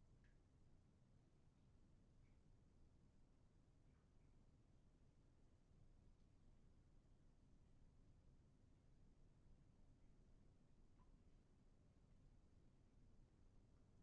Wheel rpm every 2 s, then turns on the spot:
0, 0, 0, 0, 0, 0, 0.
none